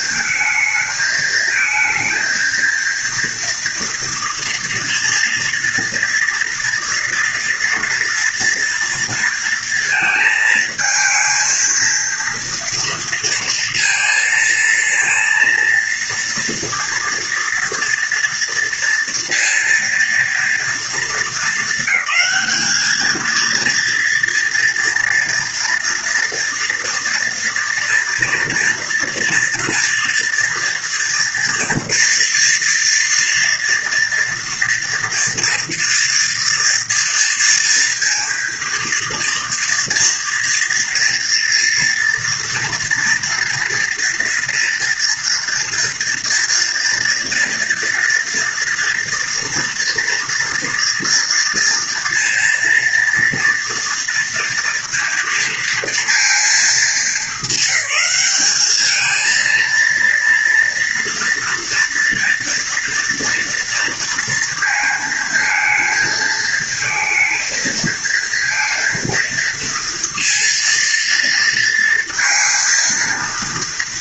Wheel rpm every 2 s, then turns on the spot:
220, 230, 230, 240, 230, 220, 230, 230, 230, 230, 220, 210, 230, 230, 230, 240, 230, 230, 230, 230, 230, 230, 230, 230, 230, 230, 230, 230, 220, 210, 230, 230, 230, 230, 230, 230, 230.
none